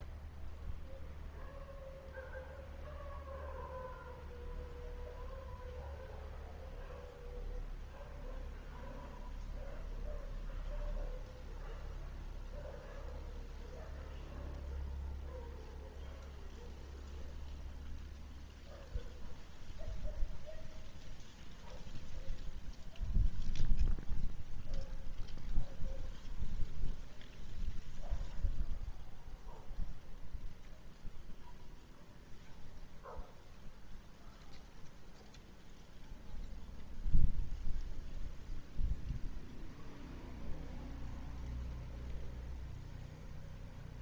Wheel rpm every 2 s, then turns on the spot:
0, 0, 0, 0, 0, 0, 0, 0, 0, 0, 0, 0, 0, 0, 0, 0, 0, 0, 0, 0, 0, 0.
none